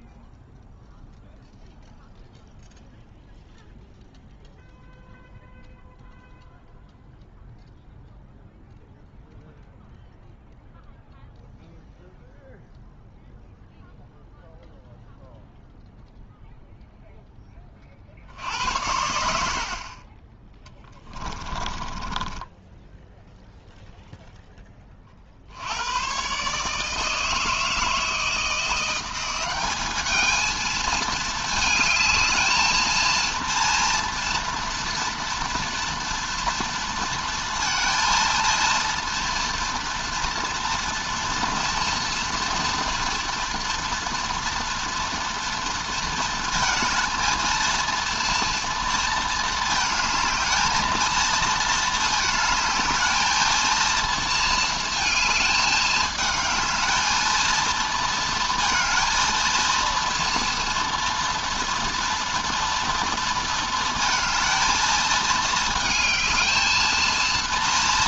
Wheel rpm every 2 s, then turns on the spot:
0, 0, 0, 0, 0, 0, 0, 0, 0, 90, 20, 10, 30, 160, 180, 220, 230, 230, 230, 230, 230, 240, 230, 230, 230, 230, 220, 220, 220, 230, 230, 230, 220, 220.
20-24